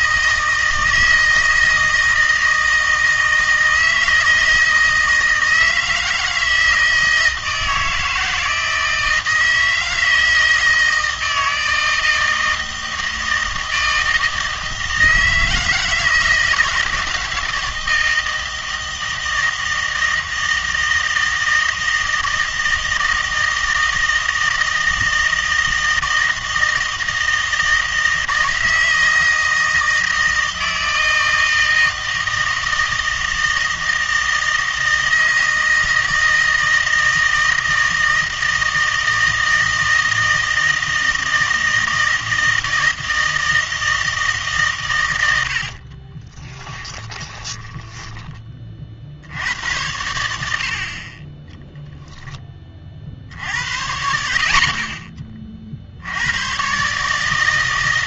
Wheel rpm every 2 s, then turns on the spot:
160, 160, 160, 160, 160, 160, 160, 160, 160, 160, 160, 160, 160, 160, 160, 160, 160, 160, 160, 160, 160, 160, 80, 30, 80, 20, 70, 30, 160.
44-48